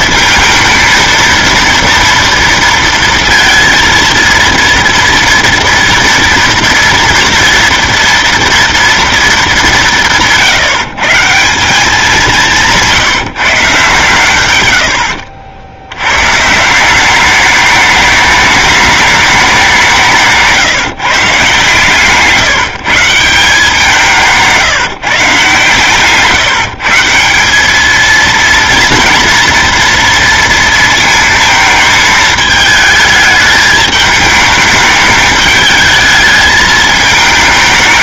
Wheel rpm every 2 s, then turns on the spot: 220, 230, 230, 230, 230, 160, 180, 110, 160, 210, 140, 160, 150, 150, 230, 230, 220, 210, 220.
12-14